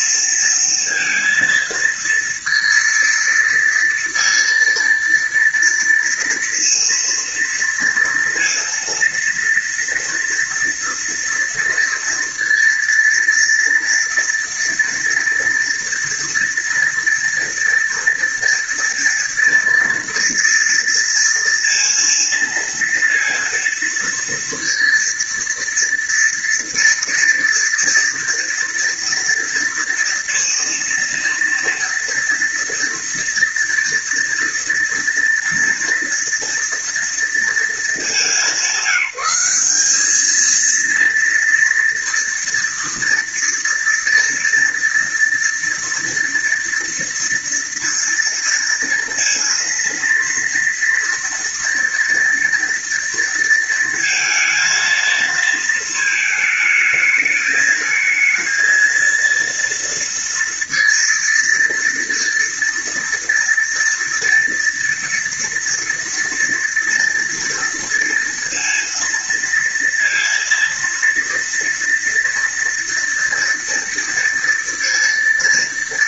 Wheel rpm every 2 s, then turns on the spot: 230, 230, 230, 230, 230, 230, 230, 230, 230, 230, 230, 230, 230, 230, 240, 230, 230, 230, 230, 200, 220, 230, 230, 230, 230, 230, 230, 230, 220, 220, 230, 230, 230, 230, 230, 230, 230, 230.
none